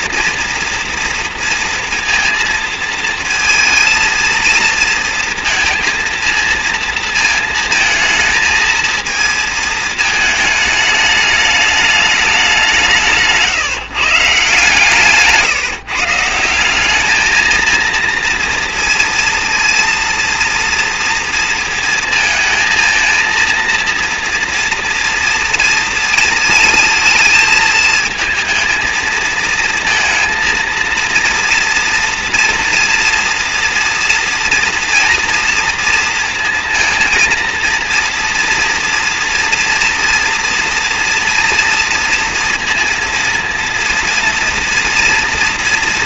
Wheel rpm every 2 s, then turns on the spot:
230, 230, 230, 220, 220, 220, 190, 150, 180, 230, 230, 220, 230, 220, 230, 230, 240, 230, 230, 230, 240, 230, 240.
none